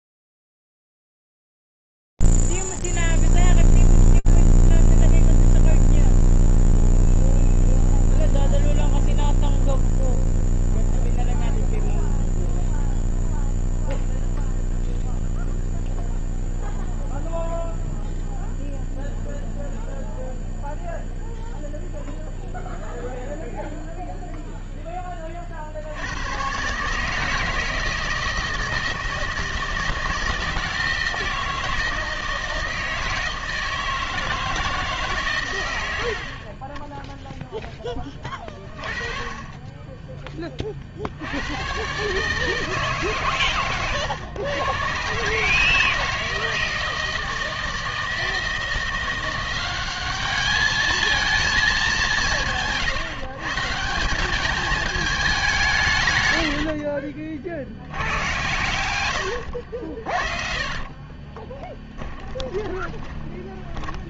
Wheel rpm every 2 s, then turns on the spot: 0, 0, 0, 0, 0, 0, 0, 0, 0, 0, 0, 0, 0, 120, 160, 160, 160, 160, 30, 30, 30, 160, 120, 160, 170, 210, 160, 210, 70, 120, 40, 20.
56-58 60-64